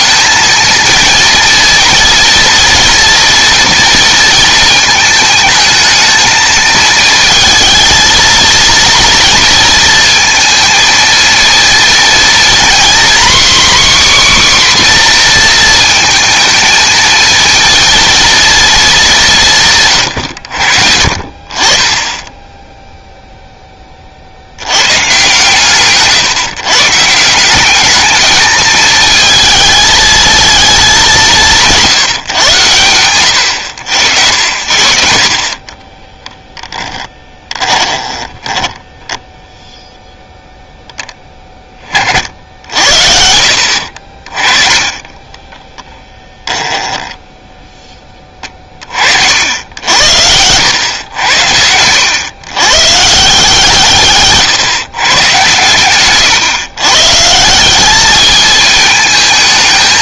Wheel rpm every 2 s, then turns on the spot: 230, 230, 220, 220, 230, 230, 250, 260, 220, 210, 60, 0, 100, 150, 220, 210, 110, 60, 10, 10, 0, 60, 20, 10, 40, 100, 130, 140, 140, 220.
36-40 46-48